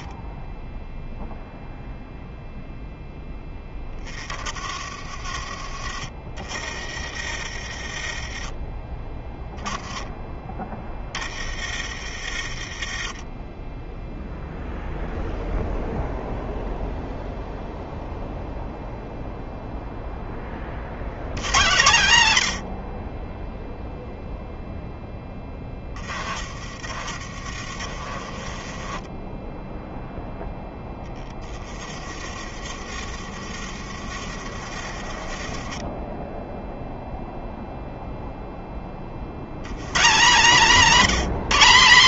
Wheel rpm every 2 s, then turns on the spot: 10, 0, 20, 30, 20, 10, 40, 0, 0, 0, 20, 100, 0, 30, 30, 0, 30, 50, 10, 10, 170.
0-2